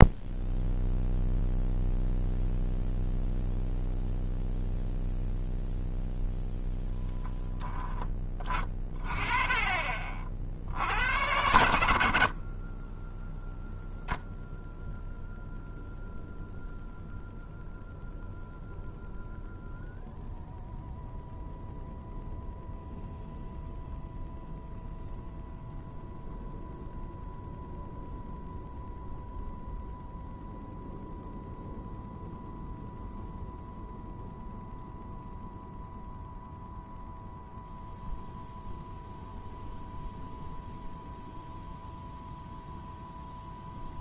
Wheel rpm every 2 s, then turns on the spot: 0, 0, 0, 10, 30, 60, 100, 80, 80, 80, 110, 120, 120, 120, 120, 120, 120, 120, 120, 120, 120, 120.
none